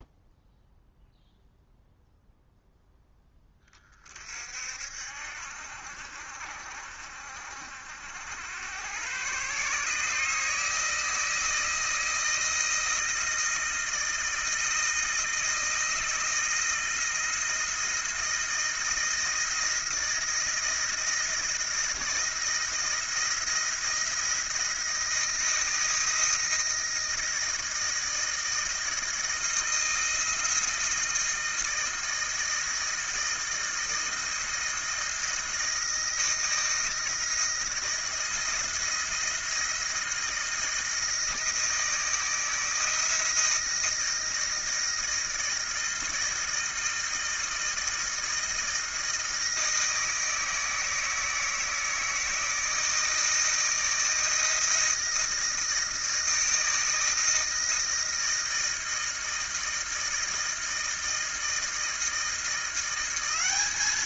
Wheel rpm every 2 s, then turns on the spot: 0, 0, 50, 50, 90, 150, 160, 160, 160, 170, 170, 160, 170, 160, 160, 160, 160, 160, 160, 170, 160, 160, 160, 160, 160, 160, 160, 160, 160, 160, 160, 170.
none